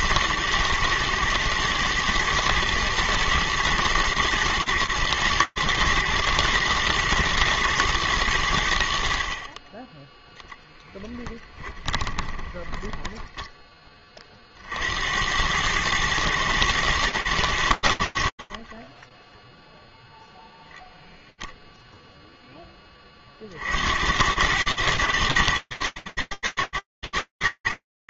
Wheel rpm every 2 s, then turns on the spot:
110, 110, 120, 120, 80, 0, 10, 80, 110, 10, 0, 50, 110, 100.
12-14